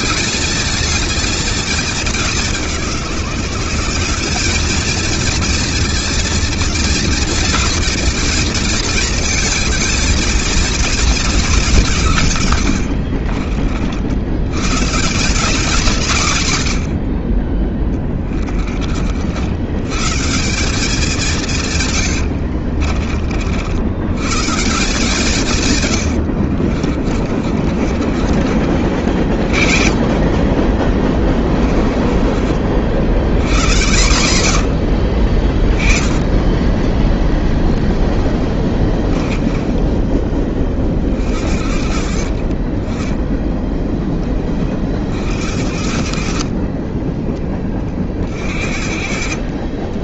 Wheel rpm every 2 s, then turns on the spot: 220, 180, 220, 230, 230, 220, 80, 170, 70, 60, 180, 50, 170, 30, 40, 30, 80, 50, 10, 10, 50, 30, 60, 20, 50.
12-14 26-28 30-32 34-40 42-44 46-48